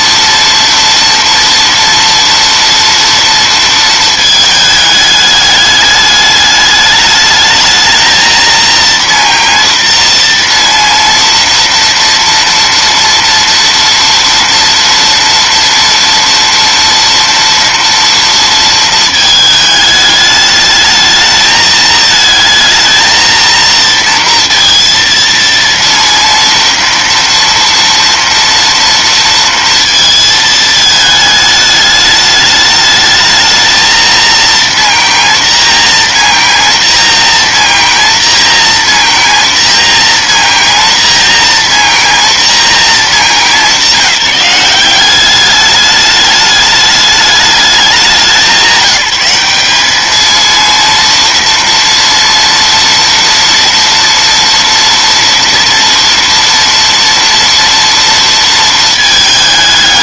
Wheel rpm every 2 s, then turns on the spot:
230, 240, 220, 210, 230, 230, 230, 230, 230, 230, 210, 220, 230, 240, 230, 220, 210, 230, 230, 230, 230, 230, 180, 210, 170, 220, 240, 230, 230, 230.
none